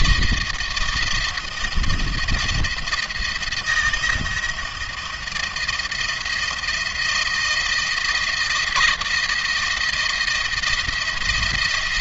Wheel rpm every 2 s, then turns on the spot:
160, 160, 170, 170, 160, 160.
none